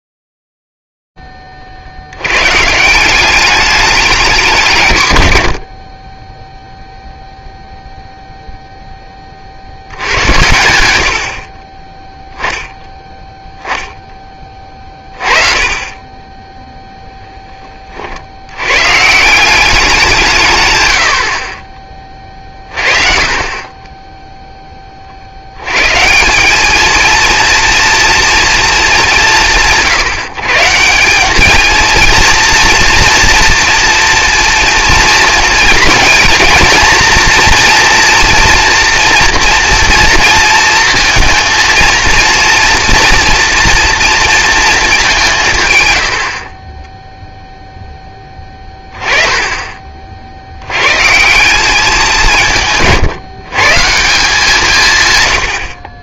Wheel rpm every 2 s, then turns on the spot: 0, 30, 190, 50, 0, 90, 10, 30, 20, 110, 110, 30, 20, 210, 220, 160, 230, 230, 230, 230, 230, 230, 220, 20, 10, 110, 140, 160.
none